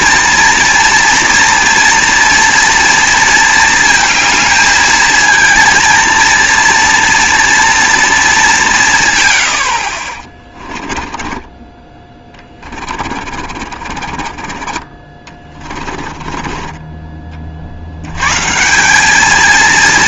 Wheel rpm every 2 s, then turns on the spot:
230, 230, 220, 230, 170, 20, 30, 30, 20, 150.
10-18